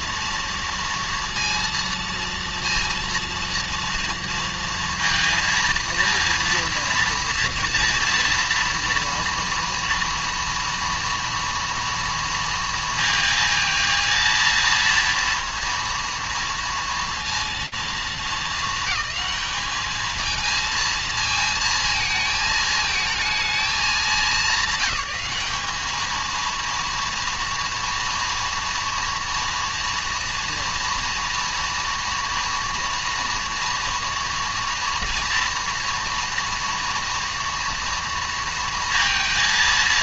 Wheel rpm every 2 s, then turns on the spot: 230, 230, 230, 230, 230, 230, 230, 230, 230, 220, 220, 220, 200, 230, 230, 230, 230, 230, 230, 230.
none